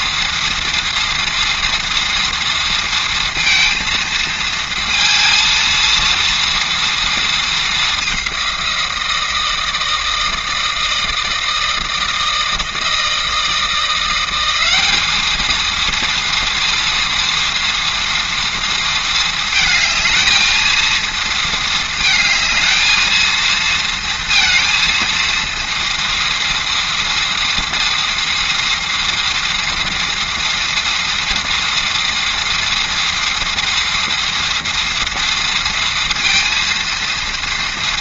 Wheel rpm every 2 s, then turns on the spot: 230, 230, 230, 230, 170, 160, 160, 200, 230, 230, 230, 220, 230, 230, 230, 230, 240, 230, 230.
none